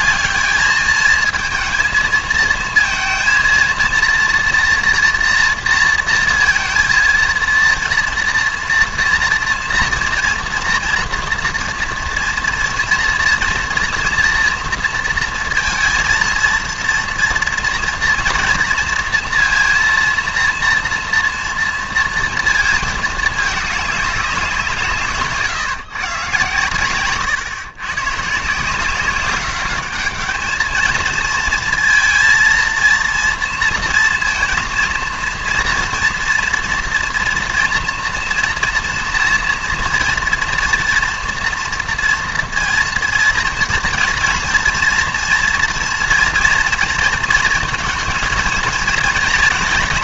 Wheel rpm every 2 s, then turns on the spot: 210, 220, 230, 230, 230, 230, 240, 230, 230, 230, 230, 230, 170, 130, 160, 220, 230, 230, 230, 230, 230, 230, 230, 230, 230.
none